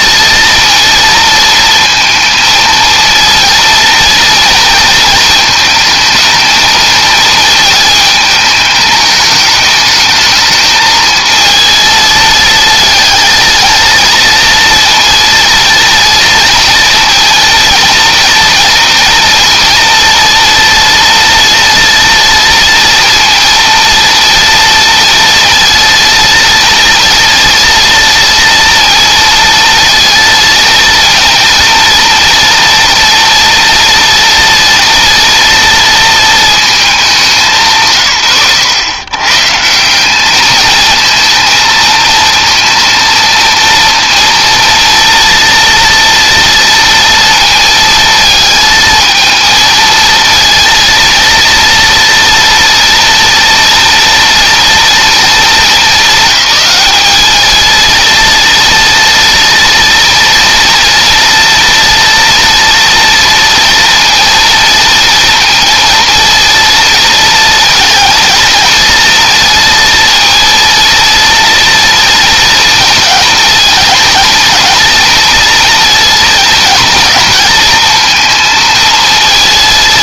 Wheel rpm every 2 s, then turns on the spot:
230, 230, 230, 220, 210, 220, 220, 230, 230, 230, 240, 230, 230, 230, 230, 230, 230, 230, 210, 110, 220, 230, 230, 230, 220, 230, 230, 230, 210, 230, 230, 230, 230, 230, 230, 230, 230, 230, 220, 230.
none